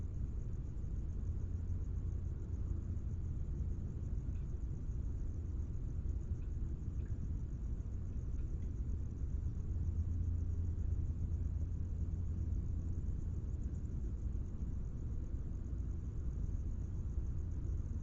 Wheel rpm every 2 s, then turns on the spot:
0, 0, 0, 0, 0, 0, 0, 0, 0.
none